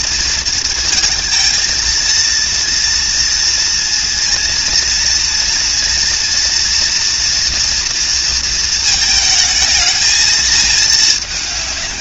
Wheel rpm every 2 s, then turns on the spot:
220, 230, 230, 230, 220, 210.
none